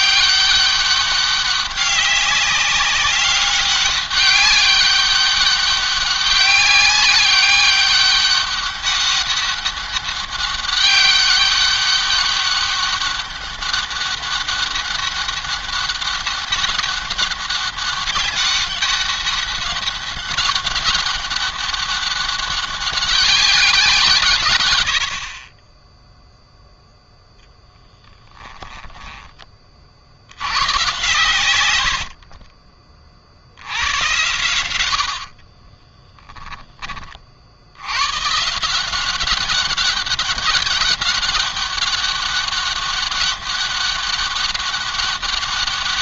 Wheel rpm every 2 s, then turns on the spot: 200, 200, 200, 190, 200, 200, 200, 200, 200, 200, 200, 200, 100, 0, 10, 110, 50, 90, 20, 170, 200, 200, 190.
28-30 34-36